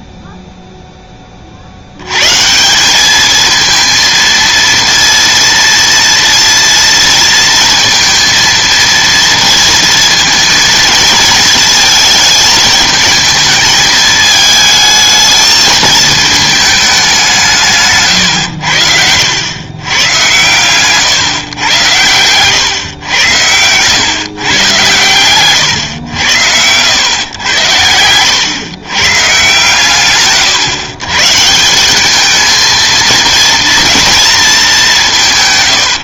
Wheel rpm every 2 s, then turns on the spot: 0, 170, 230, 230, 230, 230, 220, 220, 210, 90, 130, 120, 120, 100, 120, 120, 220, 220.
22-24